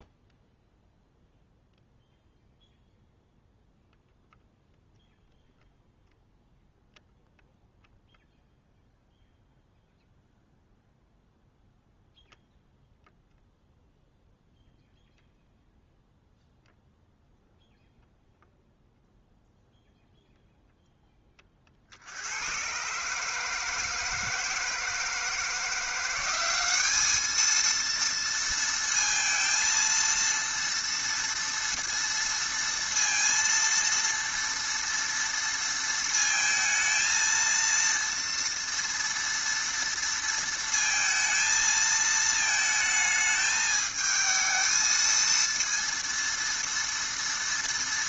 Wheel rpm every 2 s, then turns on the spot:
0, 0, 0, 0, 0, 0, 0, 0, 0, 0, 0, 110, 160, 200, 230, 230, 230, 230, 220, 230, 230, 220, 220, 230.
none